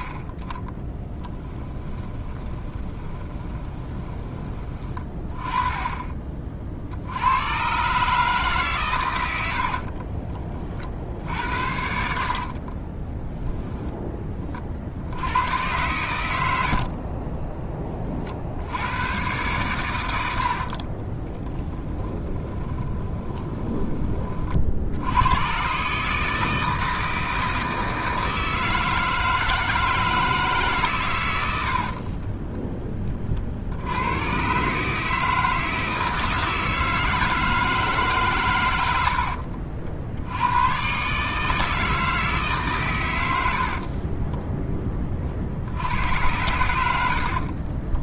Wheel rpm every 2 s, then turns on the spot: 10, 20, 20, 50, 130, 40, 40, 40, 80, 70, 50, 20, 50, 160, 160, 150, 20, 130, 160, 110, 110, 150, 10, 90.
2-4 12-14 20-24 46-48